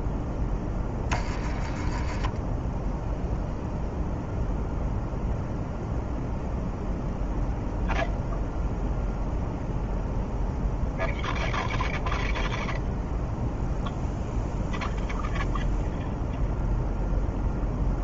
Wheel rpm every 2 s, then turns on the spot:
10, 10, 0, 0, 0, 0, 0, 0, 0.
none